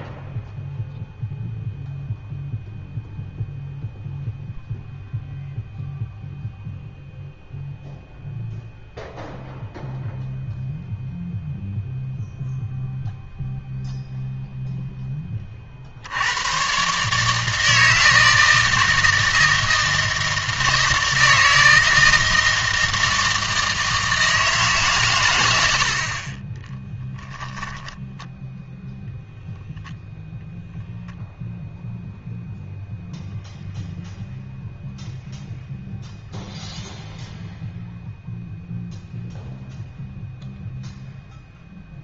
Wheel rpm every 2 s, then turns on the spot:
0, 0, 0, 0, 0, 0, 0, 0, 120, 160, 160, 160, 150, 20, 0, 0, 0, 0, 0, 0, 0.
26-28